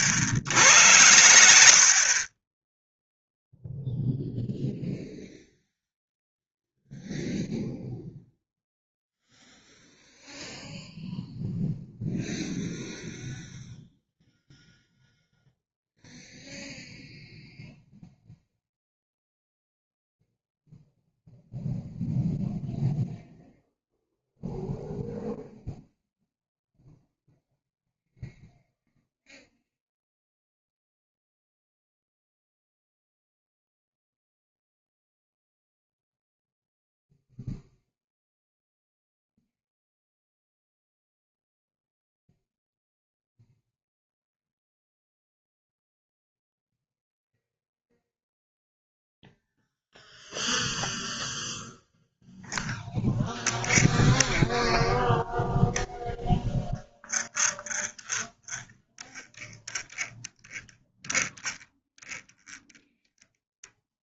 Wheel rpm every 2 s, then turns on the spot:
70, 20, 0, 0, 0, 0, 0, 0, 0, 0, 0, 0, 0, 0, 0, 0, 0, 0, 0, 0, 0, 0, 0, 0, 0, 0, 0, 0, 0, 0, 0, 0.
none